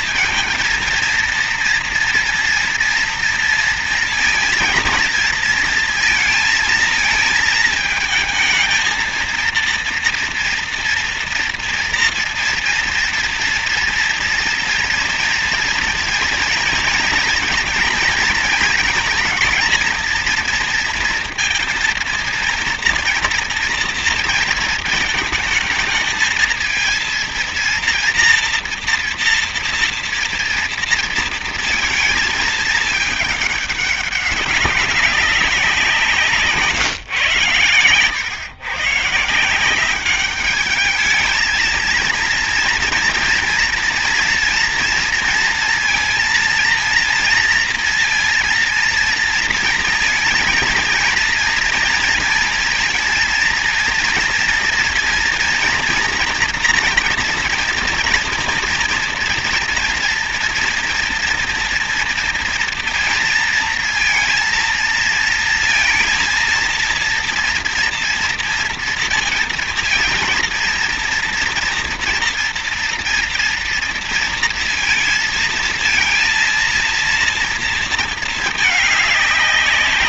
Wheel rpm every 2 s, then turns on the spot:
230, 230, 230, 220, 230, 230, 230, 230, 230, 230, 230, 230, 220, 230, 240, 230, 220, 200, 130, 140, 210, 230, 230, 230, 230, 230, 230, 230, 230, 240, 240, 230, 230, 230, 230, 230, 230, 230, 230, 210.
none